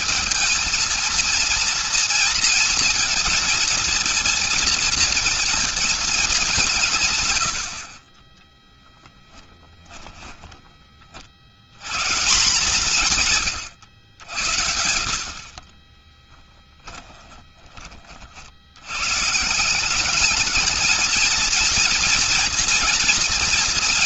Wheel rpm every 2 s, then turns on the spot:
220, 230, 230, 200, 20, 30, 170, 60, 10, 90, 210, 230.
8-10 12-14